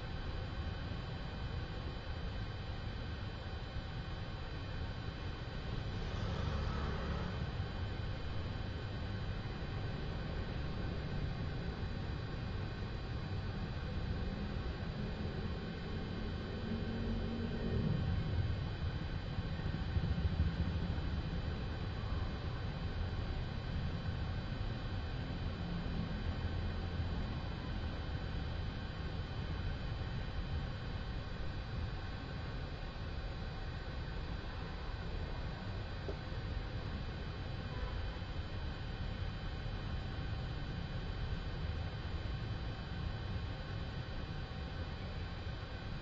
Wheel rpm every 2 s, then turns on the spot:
0, 0, 0, 0, 0, 0, 0, 0, 0, 0, 0, 0, 0, 0, 0, 0, 0, 0, 0, 0, 0, 0, 0.
none